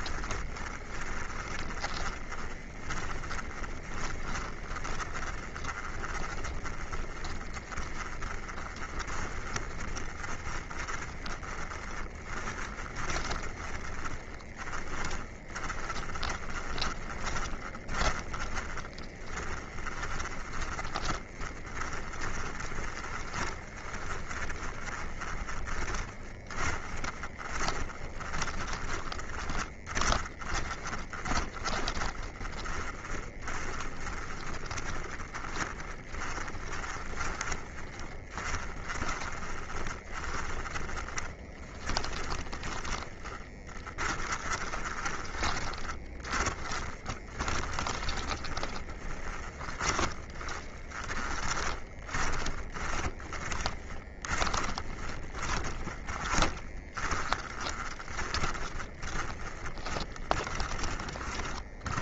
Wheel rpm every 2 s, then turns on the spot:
20, 30, 20, 30, 20, 40, 20, 20, 20, 20, 20, 20, 20, 10, 10, 20, 20, 10, 20, 20, 30, 30, 20, 10, 20, 20, 20, 20, 20, 30, 30.
0-62